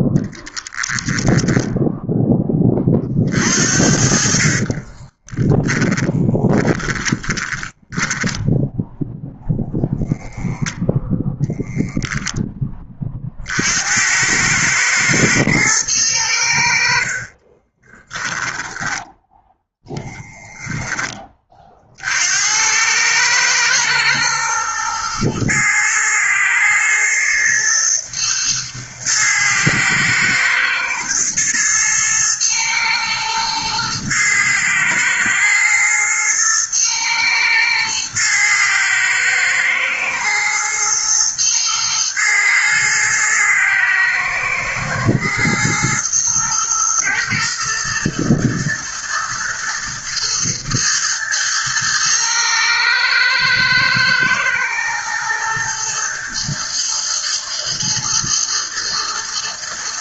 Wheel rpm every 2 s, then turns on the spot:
10, 30, 30, 20, 0, 0, 20, 110, 60, 10, 10, 100, 110, 120, 110, 110, 110, 110, 110, 110, 120, 110, 110, 110, 120, 120, 110, 120, 120, 110.
4-8 18-20